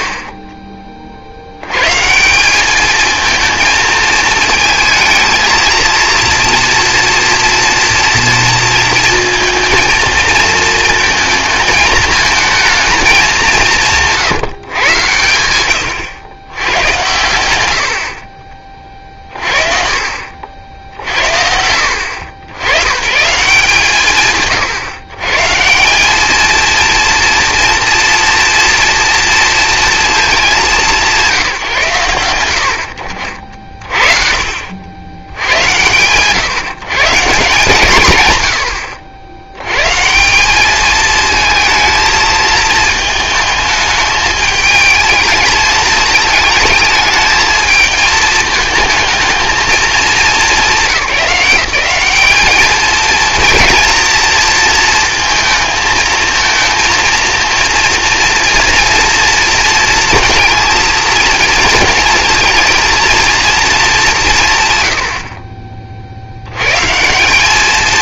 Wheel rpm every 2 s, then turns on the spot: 30, 200, 230, 230, 230, 220, 220, 140, 100, 40, 60, 90, 140, 220, 230, 210, 80, 70, 130, 110, 200, 220, 220, 220, 220, 200, 220, 230, 230, 240, 230, 230, 120, 120.
none